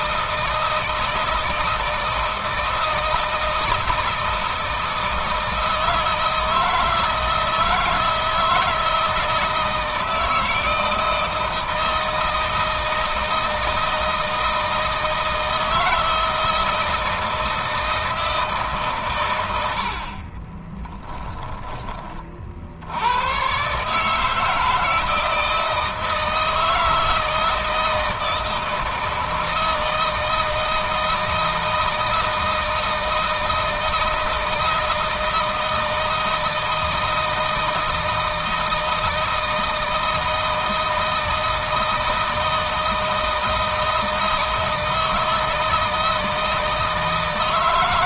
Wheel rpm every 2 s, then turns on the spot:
160, 160, 160, 160, 160, 160, 160, 160, 170, 140, 10, 60, 160, 160, 160, 160, 160, 160, 160, 160, 160, 160, 160, 160.
20-22